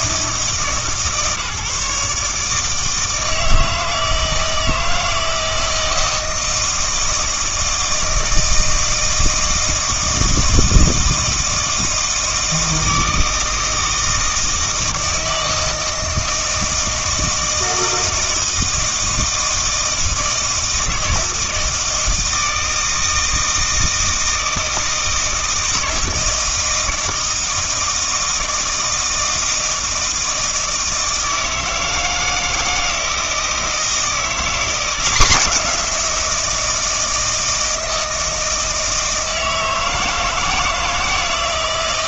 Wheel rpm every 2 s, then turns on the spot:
150, 160, 160, 160, 160, 160, 160, 160, 160, 160, 160, 160, 160, 160, 160, 160, 160, 180, 160, 160, 160.
none